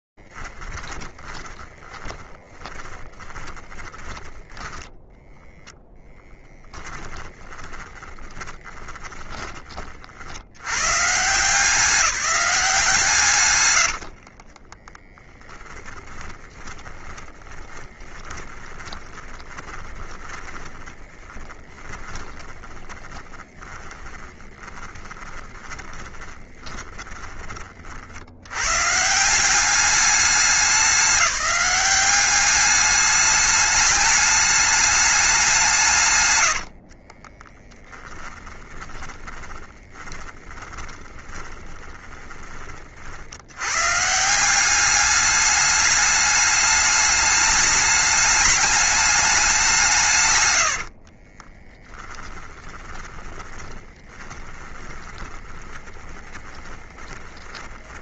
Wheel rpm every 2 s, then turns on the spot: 0, 30, 20, 10, 20, 60, 190, 70, 30, 20, 20, 20, 20, 20, 150, 190, 210, 210, 60, 20, 20, 60, 200, 210, 210, 50, 20, 20, 20.
2-6 8-10 14-28 36-42 50-58